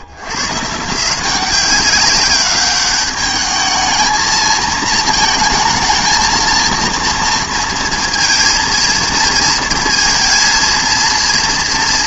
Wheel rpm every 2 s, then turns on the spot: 70, 200, 220, 230, 230, 230.
none